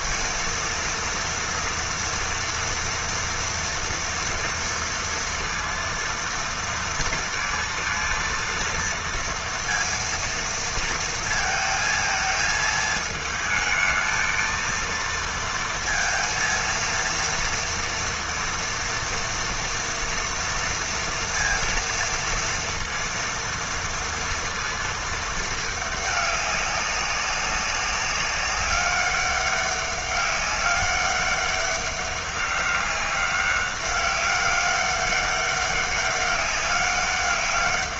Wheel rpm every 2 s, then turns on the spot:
230, 230, 230, 230, 230, 230, 220, 230, 230, 230, 230, 230, 230, 200, 200, 200, 200, 200, 200.
none